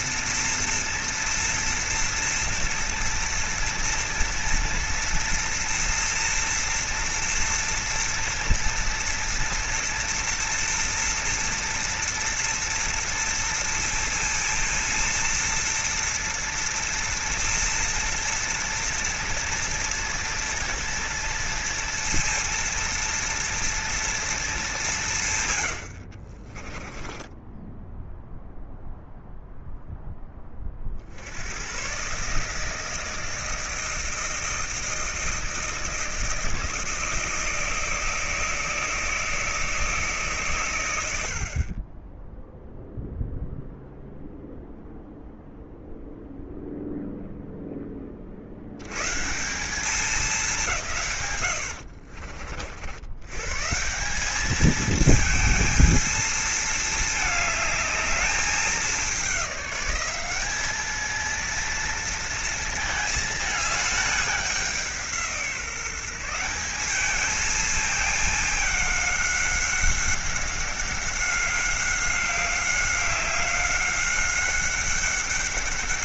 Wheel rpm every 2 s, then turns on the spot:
230, 230, 230, 230, 230, 230, 230, 230, 230, 230, 230, 230, 200, 30, 0, 60, 160, 160, 160, 160, 100, 0, 0, 0, 110, 150, 80, 220, 220, 210, 210, 220, 180, 200, 210, 190, 190, 200.
26-28